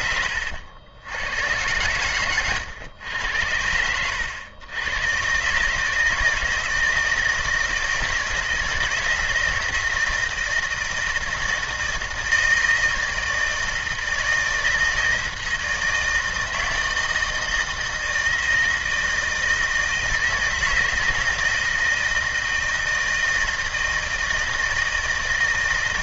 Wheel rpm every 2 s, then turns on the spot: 90, 100, 110, 160, 160, 160, 160, 160, 160, 160, 160, 160, 160.
none